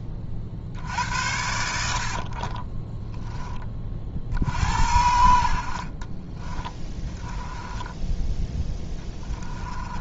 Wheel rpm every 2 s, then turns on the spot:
60, 20, 70, 10, 10.
2-4